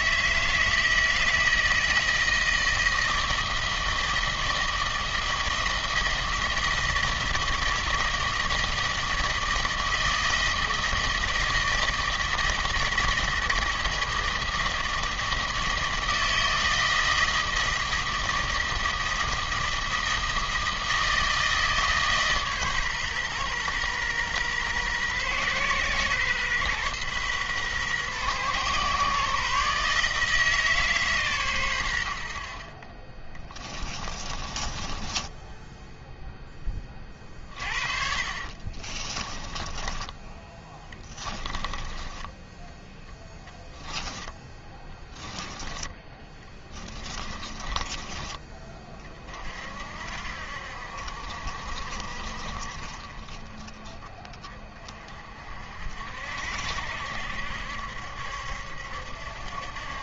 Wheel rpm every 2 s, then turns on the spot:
160, 160, 160, 160, 160, 160, 160, 160, 160, 160, 160, 130, 120, 120, 130, 150, 30, 20, 20, 30, 10, 10, 10, 20, 30, 60, 40, 40, 70, 70.
34-36 38-42 44-48